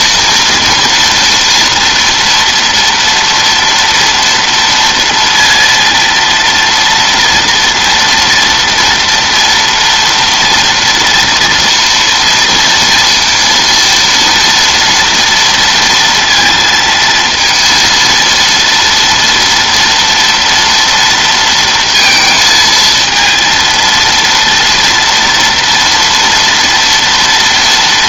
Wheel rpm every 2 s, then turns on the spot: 230, 230, 230, 230, 230, 230, 230, 230, 230, 230, 230, 220, 230, 230.
none